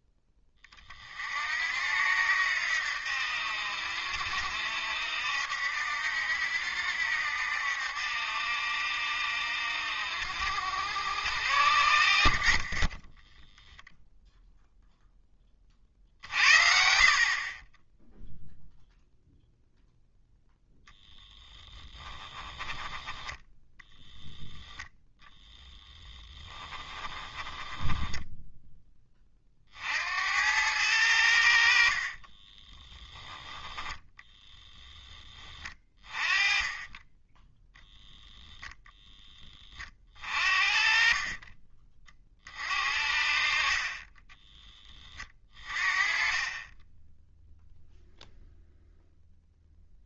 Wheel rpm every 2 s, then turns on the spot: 30, 80, 70, 70, 70, 80, 30, 0, 60, 0, 0, 10, 0, 20, 10, 90, 10, 10, 20, 0, 40, 50, 20, 10, 0.
22-24 26-28 32-34 36-38 46-48